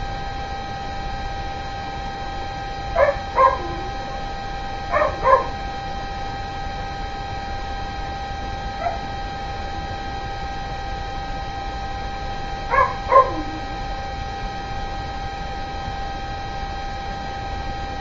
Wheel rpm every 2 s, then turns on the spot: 0, 0, 0, 0, 0, 0, 0, 0, 0.
none